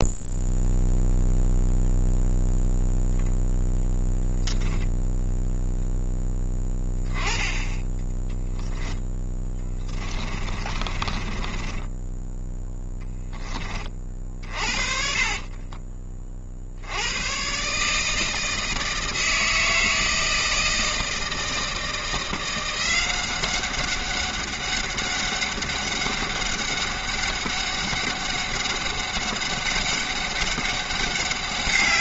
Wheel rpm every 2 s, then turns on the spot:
0, 0, 0, 10, 10, 30, 10, 40, 50, 160, 160, 170, 200, 200, 200, 200.
8-16